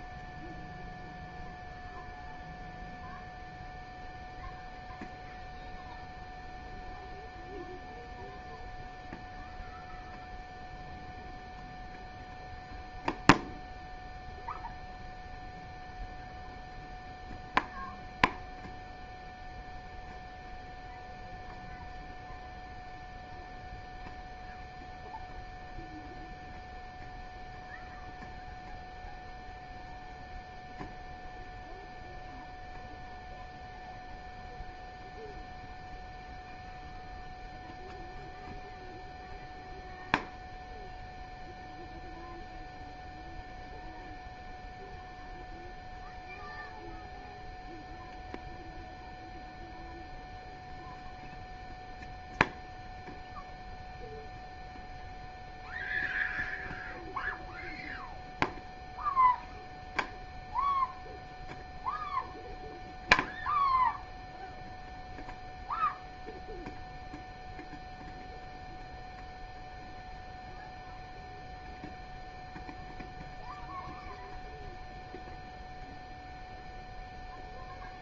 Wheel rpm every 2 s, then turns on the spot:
0, 0, 0, 0, 0, 0, 0, 0, 0, 0, 0, 0, 0, 0, 0, 0, 0, 0, 0, 0, 0, 0, 0, 0, 0, 0, 0, 0, 0, 0, 0, 0, 0, 0, 0, 0, 0, 0, 0.
none